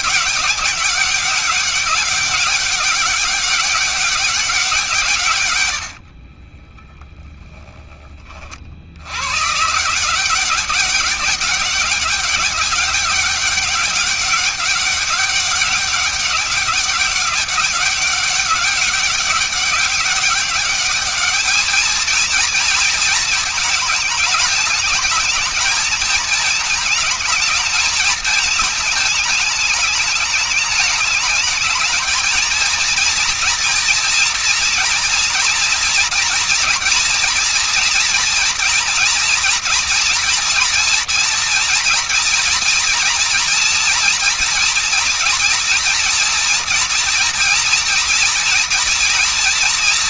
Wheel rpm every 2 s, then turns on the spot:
200, 200, 190, 30, 40, 180, 200, 200, 200, 190, 200, 240, 220, 220, 220, 210, 230, 240, 240, 230, 240, 230, 230, 230, 230.
6-8